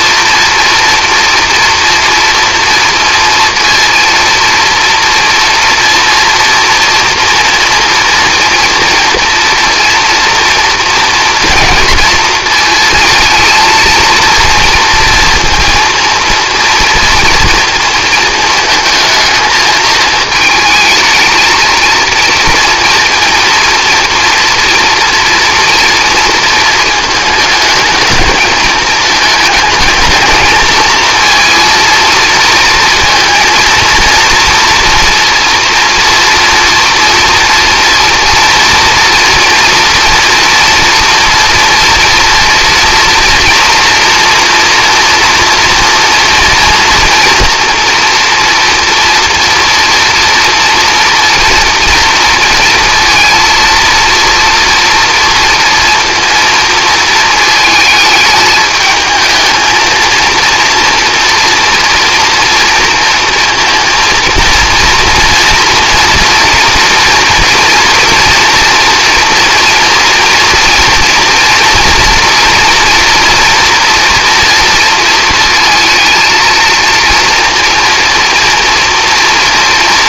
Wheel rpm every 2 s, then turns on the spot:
230, 230, 240, 240, 240, 230, 230, 230, 230, 220, 220, 230, 230, 220, 220, 220, 230, 230, 240, 230, 230, 230, 230, 230, 230, 230, 230, 230, 230, 220, 230, 230, 230, 230, 240, 230, 240, 230, 230, 230.
none